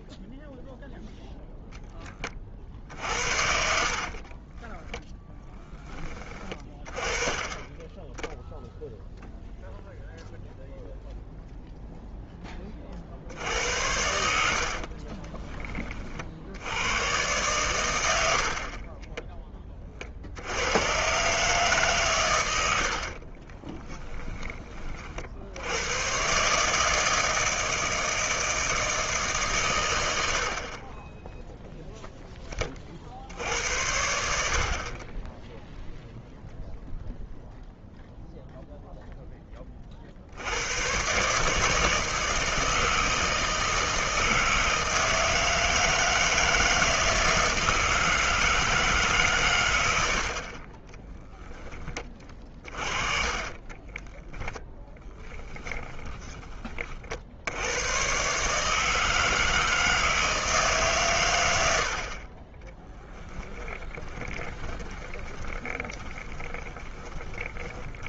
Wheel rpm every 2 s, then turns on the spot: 0, 40, 20, 20, 0, 0, 20, 60, 80, 50, 90, 100, 30, 140, 160, 50, 20, 60, 0, 0, 100, 160, 160, 160, 160, 40, 30, 10, 20, 150, 150, 20, 20, 20.
4-6 14-16 34-36 50-56 64-68